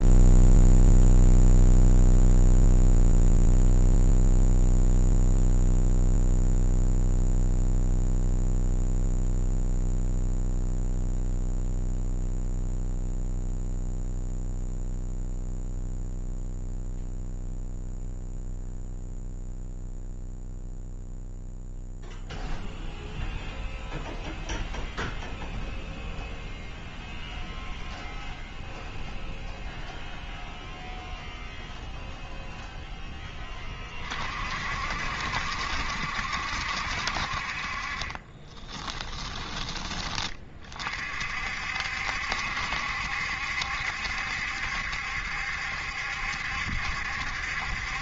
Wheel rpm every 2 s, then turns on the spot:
0, 0, 0, 0, 0, 0, 0, 0, 0, 0, 0, 0, 0, 0, 0, 0, 0, 60, 60, 20, 30, 70, 70, 70.
38-40